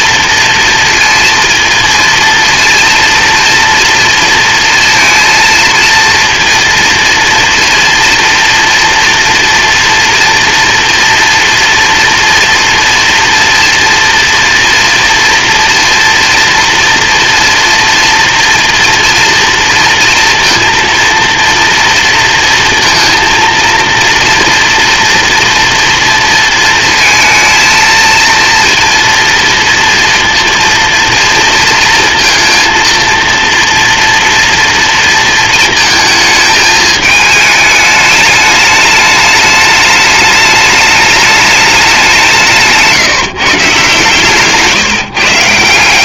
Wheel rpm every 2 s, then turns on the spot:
230, 230, 230, 230, 230, 240, 230, 230, 230, 230, 230, 230, 230, 230, 230, 230, 230, 230, 210, 210, 210, 150, 160.
none